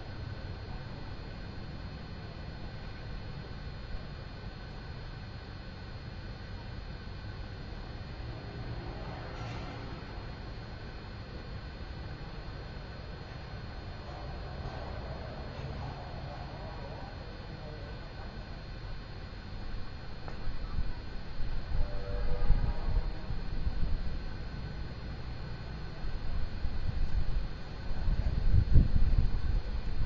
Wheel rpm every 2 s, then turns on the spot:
0, 0, 0, 0, 0, 0, 0, 0, 0, 0, 0, 0, 0, 0, 0.
none